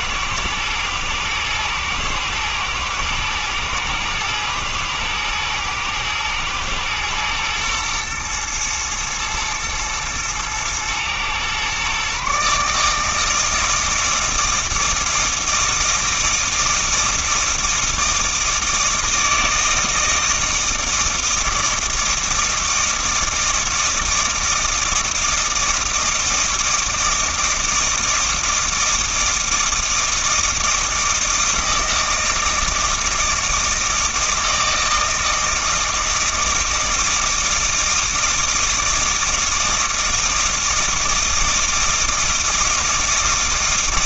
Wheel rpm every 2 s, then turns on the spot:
110, 110, 120, 120, 120, 120, 150, 160, 160, 160, 160, 160, 160, 160, 160, 160, 160, 160, 160, 160, 160, 160.
none